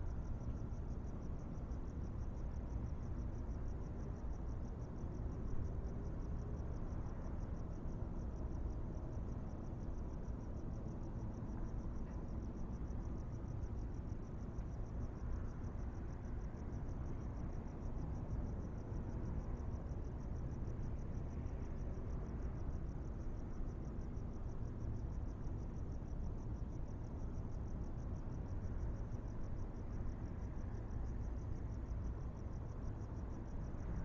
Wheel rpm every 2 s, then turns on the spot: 0, 0, 0, 0, 0, 0, 0, 0, 0, 0, 0, 0, 0, 0, 0, 0, 0.
none